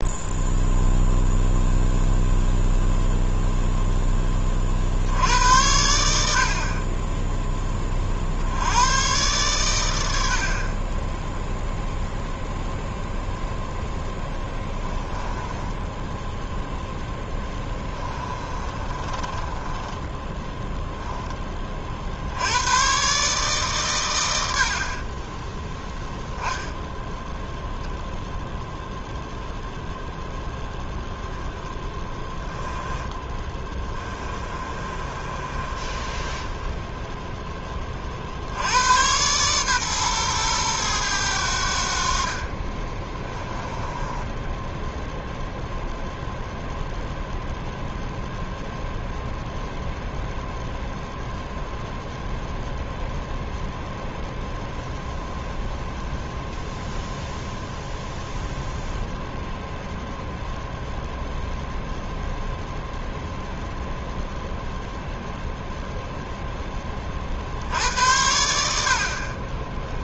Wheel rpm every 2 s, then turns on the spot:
0, 0, 50, 30, 110, 20, 0, 20, 0, 30, 10, 110, 60, 0, 0, 0, 10, 30, 10, 90, 110, 30, 0, 0, 0, 0, 0, 0, 0, 0, 0, 0, 0, 10, 60.
14-16 18-20 32-38 42-44